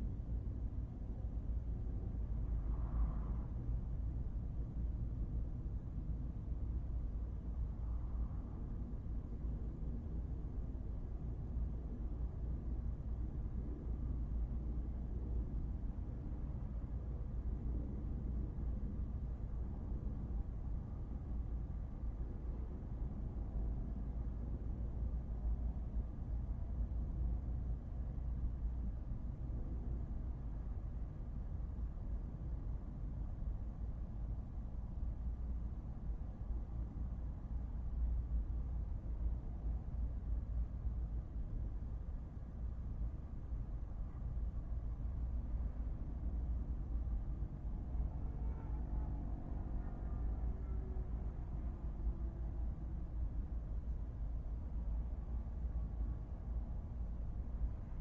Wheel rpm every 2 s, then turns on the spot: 0, 0, 0, 0, 0, 0, 0, 0, 0, 0, 0, 0, 0, 0, 0, 0, 0, 0, 0, 0, 0, 0, 0, 0, 0, 0, 0, 0, 0.
none